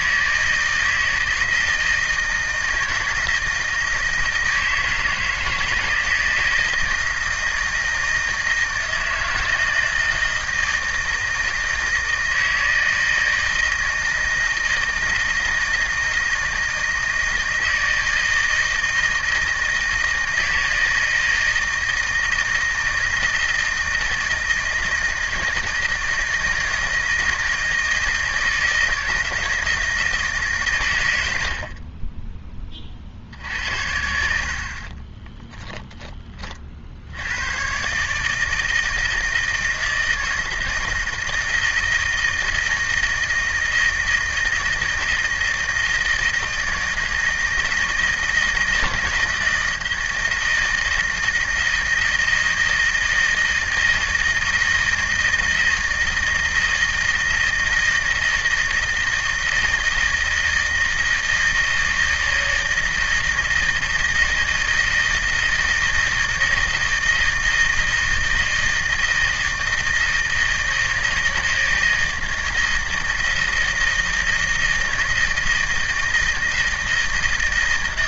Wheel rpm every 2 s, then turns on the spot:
160, 160, 160, 160, 160, 160, 160, 160, 160, 160, 160, 160, 160, 160, 160, 140, 30, 60, 30, 160, 160, 160, 160, 160, 160, 160, 160, 160, 160, 160, 160, 160, 160, 160, 160, 160, 160, 160, 160.
none